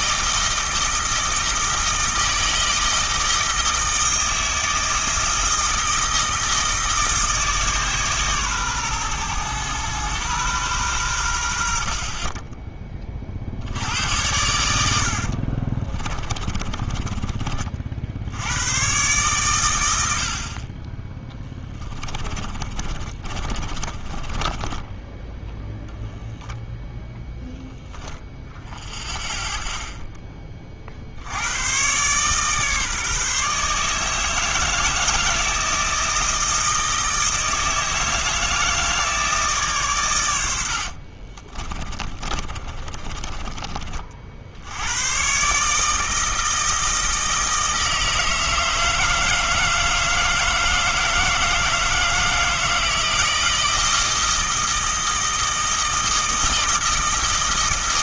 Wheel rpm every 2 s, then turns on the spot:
160, 160, 160, 160, 130, 110, 20, 80, 20, 110, 30, 30, 20, 0, 10, 50, 140, 160, 160, 160, 50, 30, 90, 160, 160, 160, 160, 160, 160.
14-18 22-26 40-44